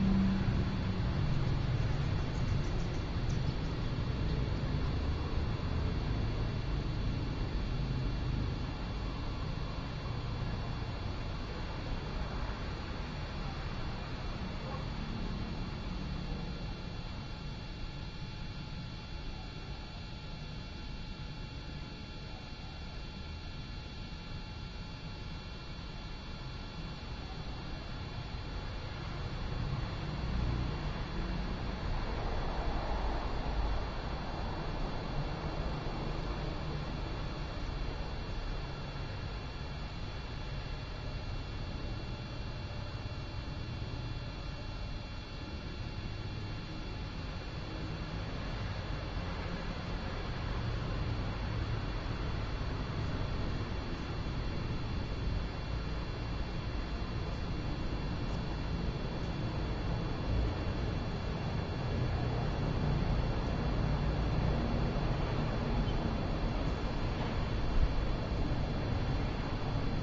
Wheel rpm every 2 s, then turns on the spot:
0, 0, 0, 0, 0, 0, 0, 0, 0, 0, 0, 0, 0, 0, 0, 0, 0, 0, 0, 0, 0, 0, 0, 0, 0, 0, 0, 0, 0, 0, 0, 0, 0, 0, 0.
none